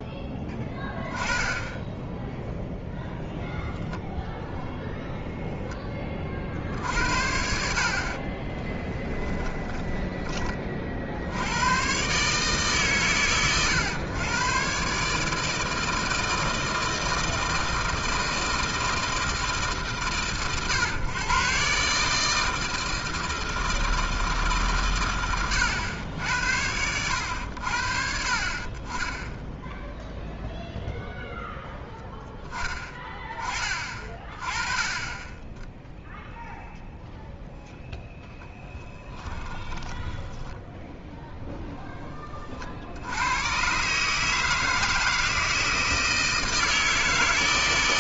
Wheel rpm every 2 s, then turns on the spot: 10, 0, 0, 50, 20, 30, 140, 130, 160, 160, 140, 160, 140, 90, 50, 0, 10, 30, 0, 0, 10, 30, 160, 160.
8-10 40-42